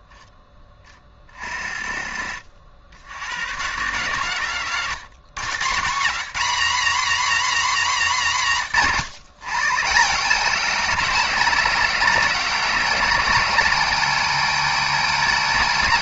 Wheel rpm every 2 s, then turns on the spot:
30, 80, 160, 260, 160, 240, 250, 250.
none